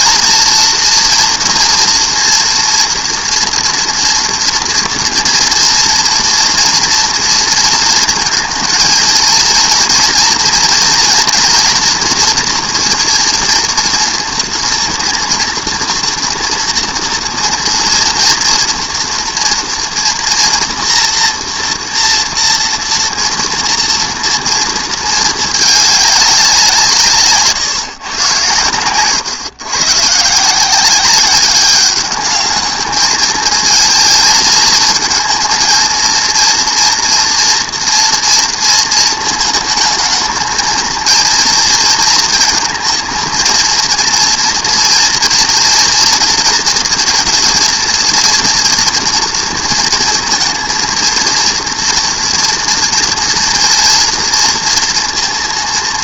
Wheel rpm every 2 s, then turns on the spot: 230, 230, 230, 240, 230, 230, 230, 230, 230, 230, 240, 230, 220, 170, 120, 180, 210, 220, 230, 230, 230, 230, 230, 230, 230, 230, 230, 230.
none